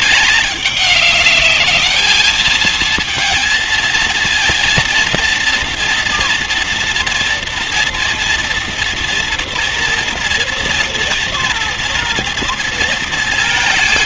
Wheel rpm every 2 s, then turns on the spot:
200, 220, 230, 230, 230, 230, 230.
none